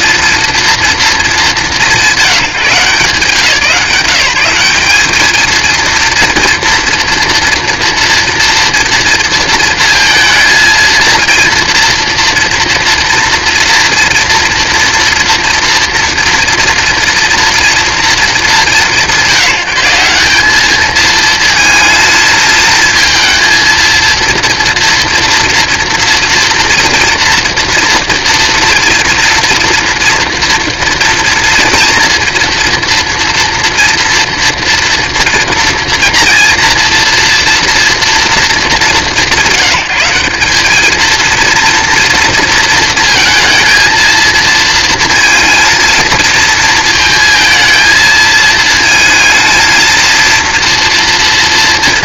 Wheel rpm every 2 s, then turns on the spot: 230, 150, 180, 230, 230, 230, 230, 230, 230, 170, 210, 220, 230, 230, 230, 230, 230, 230, 230, 170, 220, 230, 230, 220, 220, 230.
none